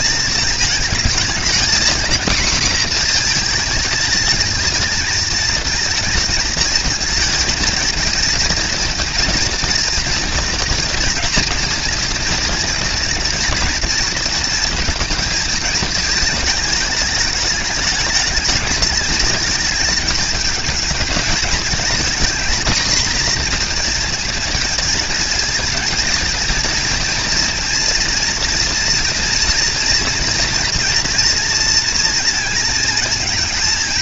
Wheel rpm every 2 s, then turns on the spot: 220, 240, 230, 220, 230, 230, 230, 230, 210, 210, 220, 230, 230, 230, 230, 230, 220.
none